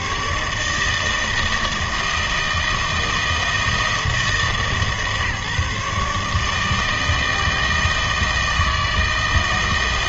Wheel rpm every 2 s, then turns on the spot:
150, 160, 150, 160, 160.
none